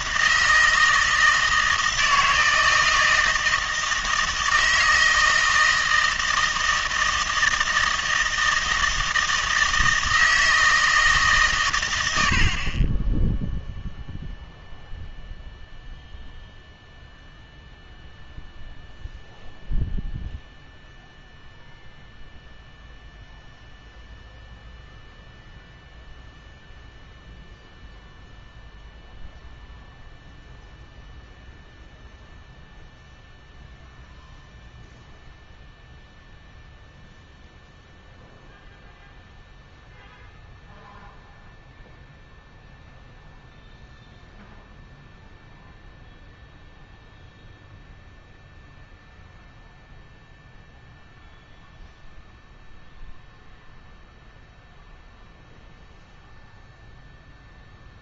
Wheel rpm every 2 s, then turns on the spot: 160, 160, 160, 160, 160, 160, 50, 0, 0, 0, 0, 0, 0, 0, 0, 0, 0, 0, 0, 0, 0, 0, 0, 0, 0, 0, 0, 0, 0.
none